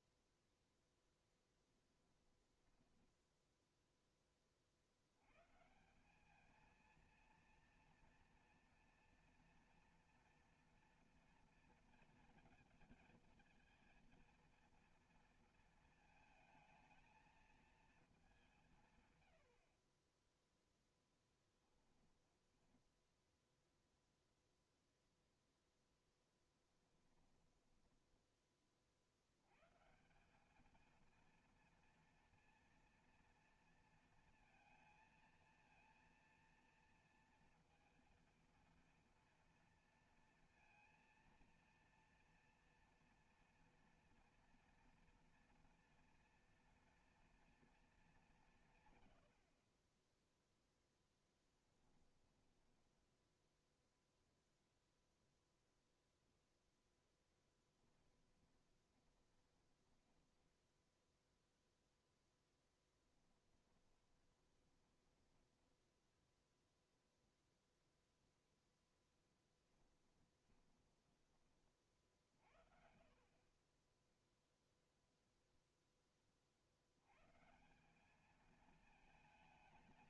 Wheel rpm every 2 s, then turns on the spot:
10, 20, 50, 220, 230, 230, 220, 230, 220, 170, 0, 10, 0, 10, 30, 220, 230, 230, 230, 230, 230, 230, 230, 240, 130, 10, 10, 0, 0, 20, 0, 10, 20, 0, 0, 20, 50, 0, 70, 220.
2-4 22-24 26-28 52-54 58-60 62-66 70-72